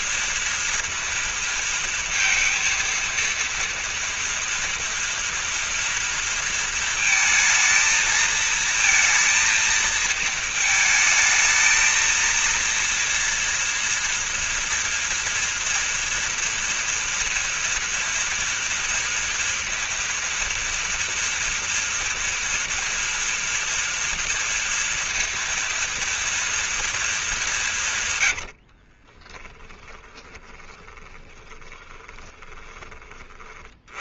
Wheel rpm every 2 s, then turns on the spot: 230, 230, 230, 230, 220, 220, 230, 230, 230, 240, 230, 230, 240, 230, 120, 20, 20.
28-34